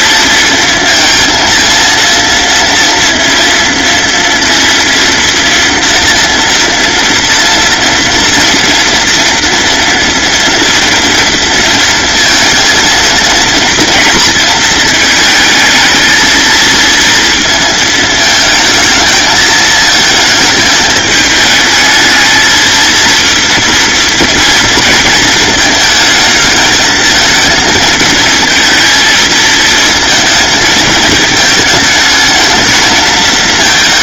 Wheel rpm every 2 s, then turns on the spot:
230, 230, 230, 230, 230, 230, 230, 220, 230, 220, 220, 230, 230, 220, 230, 230, 220.
none